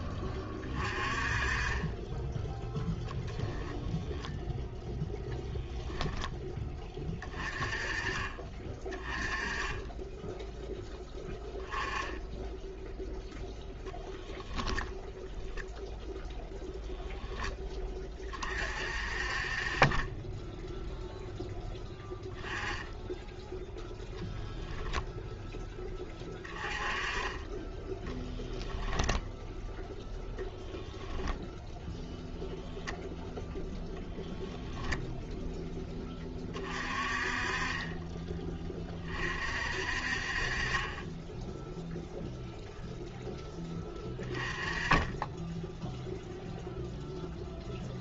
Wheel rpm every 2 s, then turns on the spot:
30, 0, 0, 20, 20, 10, 0, 0, 10, 40, 0, 10, 0, 20, 0, 0, 0, 10, 30, 30, 30, 0, 20, 0.
none